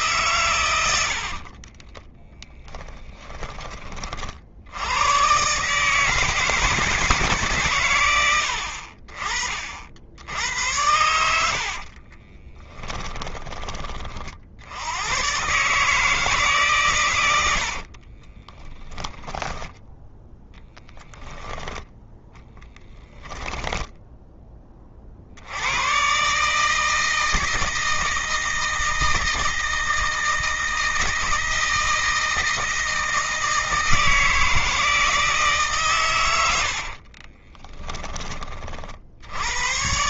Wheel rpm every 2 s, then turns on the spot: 80, 10, 90, 160, 50, 90, 20, 90, 130, 10, 10, 10, 20, 150, 160, 160, 160, 160, 60, 50.
0-4 12-14 18-20 22-24 36-38